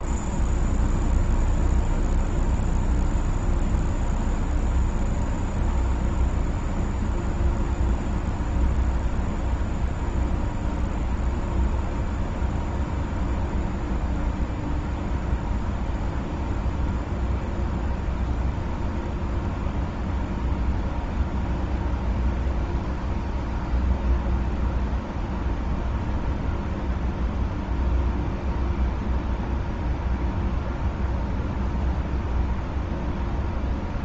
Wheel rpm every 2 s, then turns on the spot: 0, 0, 0, 0, 0, 0, 0, 0, 0, 0, 0, 0, 0, 0, 0, 0, 0.
none